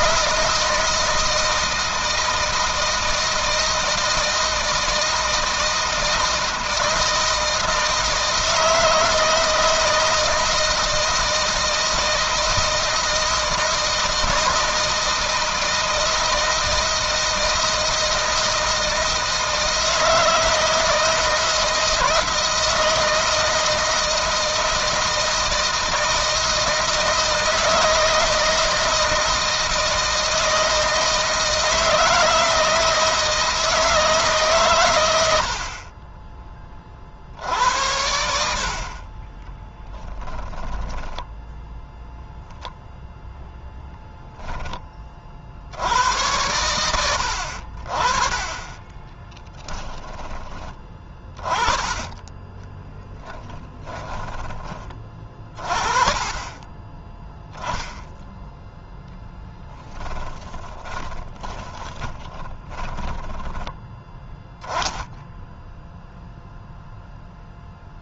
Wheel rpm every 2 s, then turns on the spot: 160, 160, 160, 160, 160, 160, 170, 160, 160, 160, 160, 160, 160, 160, 160, 160, 160, 120, 30, 60, 10, 0, 20, 90, 10, 20, 10, 30, 30, 0, 20, 30, 10, 0.
40-42 52-54 60-64